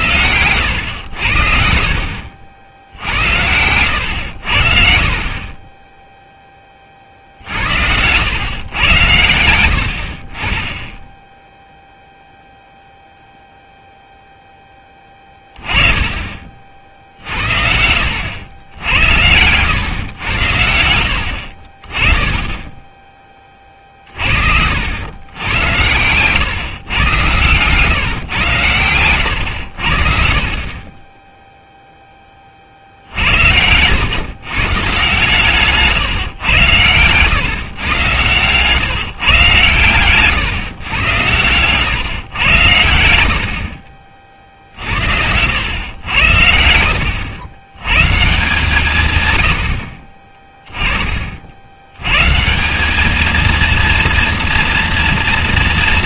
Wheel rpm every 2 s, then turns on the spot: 90, 70, 60, 30, 110, 20, 0, 10, 40, 90, 80, 20, 70, 130, 110, 30, 50, 140, 110, 130, 130, 90, 60, 70, 150, 20, 170, 230.
none